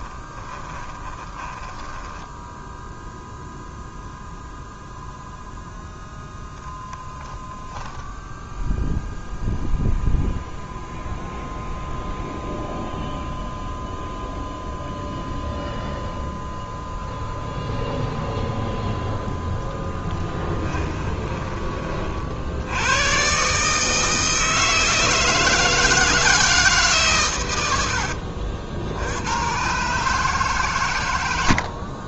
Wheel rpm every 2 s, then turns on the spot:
20, 0, 0, 0, 0, 0, 0, 0, 0, 0, 20, 90, 160, 150, 70, 120.
0-2 20-22